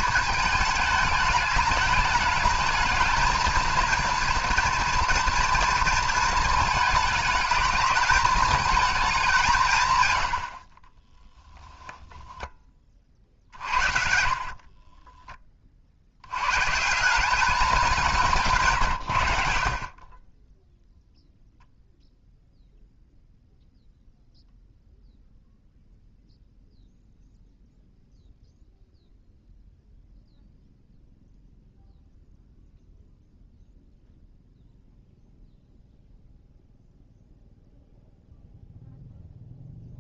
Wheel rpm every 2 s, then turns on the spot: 220, 220, 230, 230, 220, 40, 20, 40, 130, 140, 10, 0, 0, 0, 0, 0, 0, 0, 0, 0.
14-16